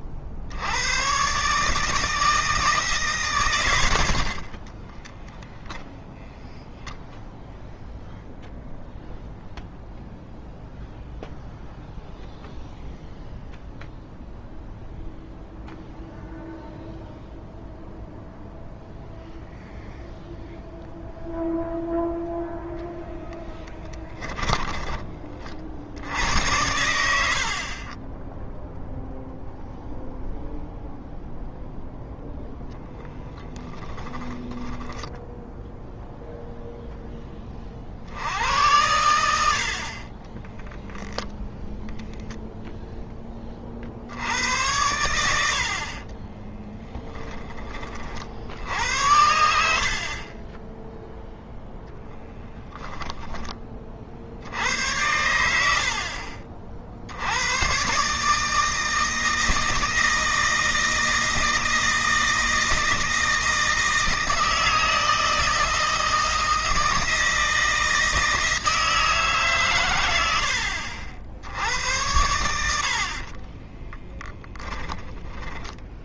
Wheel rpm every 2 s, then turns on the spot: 90, 160, 30, 0, 0, 0, 0, 0, 0, 0, 0, 0, 20, 90, 0, 0, 0, 10, 0, 90, 0, 0, 80, 20, 80, 10, 10, 80, 60, 160, 160, 160, 160, 160, 160, 70, 60, 10.
4-6 46-54